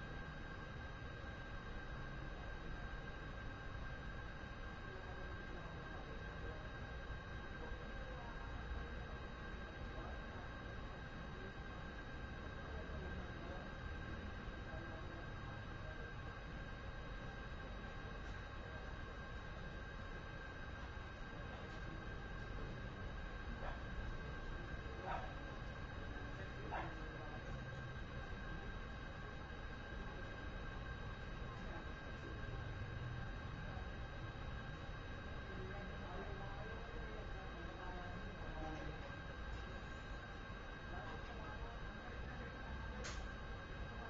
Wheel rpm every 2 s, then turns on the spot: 0, 0, 0, 0, 0, 0, 0, 0, 0, 0, 0, 0, 0, 0, 0, 0, 0, 0, 0, 0, 0, 0.
none